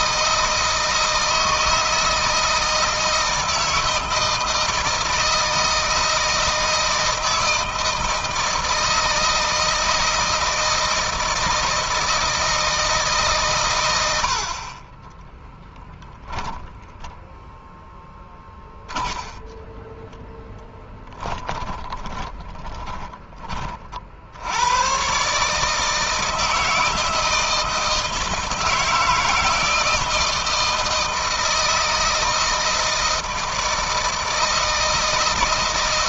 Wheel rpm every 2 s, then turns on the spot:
160, 160, 160, 160, 160, 160, 160, 50, 10, 20, 10, 20, 90, 160, 160, 170, 160, 160.
16-24